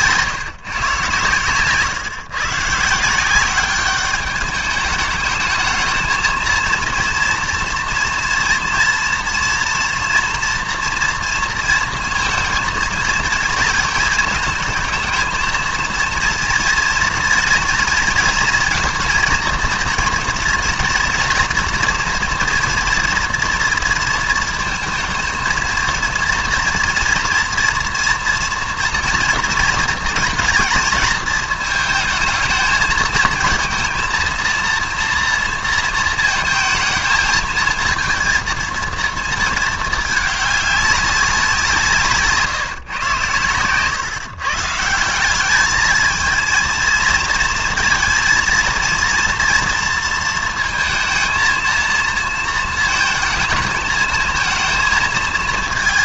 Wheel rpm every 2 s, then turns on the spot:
150, 130, 210, 230, 230, 230, 230, 220, 230, 230, 230, 240, 230, 230, 230, 230, 220, 230, 230, 230, 200, 150, 150, 230, 230, 230, 230, 220.
none